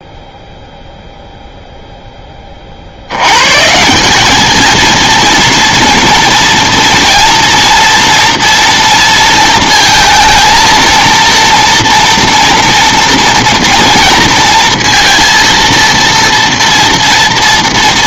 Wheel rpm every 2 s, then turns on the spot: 0, 40, 220, 230, 230, 230, 230, 230, 230.
none